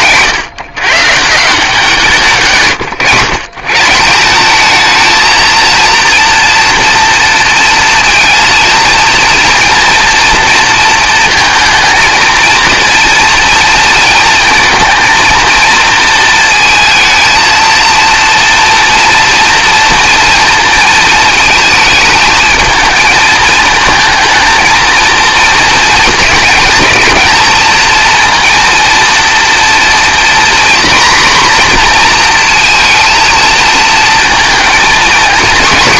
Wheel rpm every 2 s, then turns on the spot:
140, 130, 220, 230, 230, 230, 230, 230, 230, 230, 230, 220, 230, 230, 230, 230, 230, 230.
none